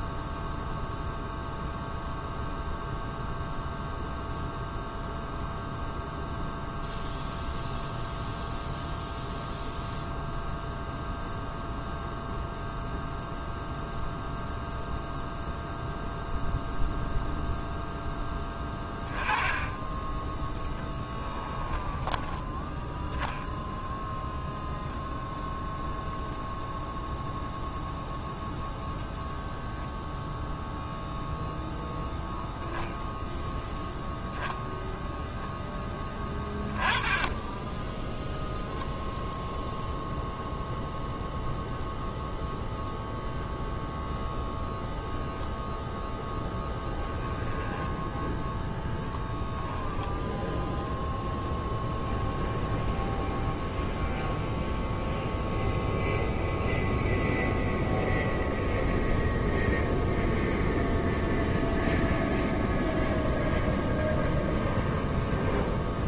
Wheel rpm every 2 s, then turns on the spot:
0, 0, 0, 0, 0, 0, 0, 0, 0, 10, 10, 10, 0, 0, 0, 0, 0, 0, 10, 0, 0, 0, 0, 0, 0, 0, 0, 0, 0, 0, 0, 0, 0.
18-22